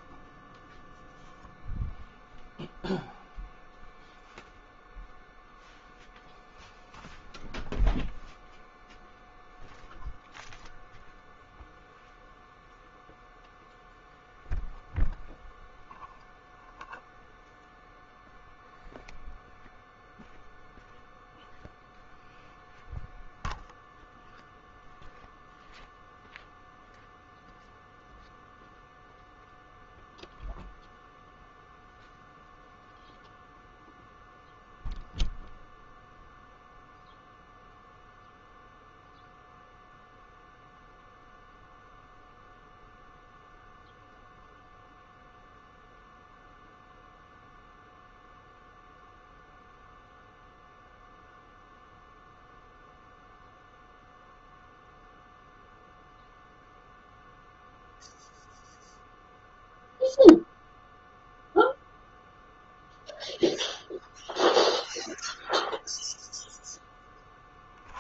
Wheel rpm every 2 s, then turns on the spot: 0, 0, 0, 0, 0, 0, 0, 0, 0, 0, 0, 0, 0, 0, 0, 0, 0, 0, 0, 0, 0, 0, 0, 0, 0, 0, 0, 0, 0, 0, 0, 0, 0, 10.
none